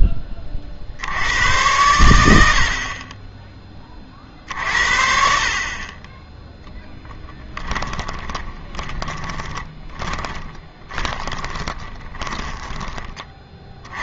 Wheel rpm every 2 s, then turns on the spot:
60, 50, 50, 10, 20, 30, 20.
4-14